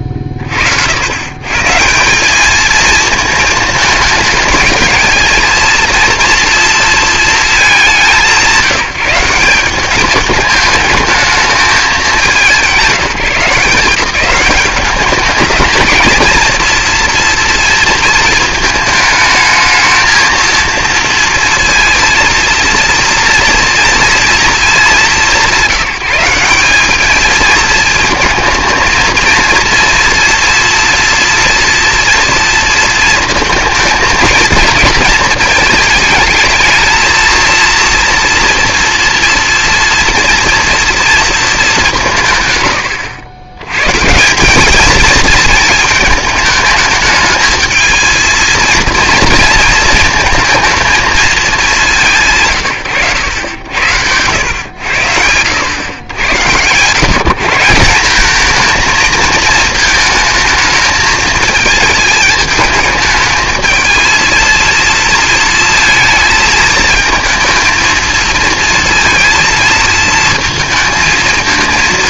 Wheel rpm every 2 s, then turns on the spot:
70, 210, 220, 230, 170, 210, 180, 200, 230, 220, 230, 230, 220, 190, 230, 230, 230, 220, 220, 230, 230, 110, 190, 210, 230, 220, 140, 100, 110, 220, 220, 210, 230, 230, 230, 230.
none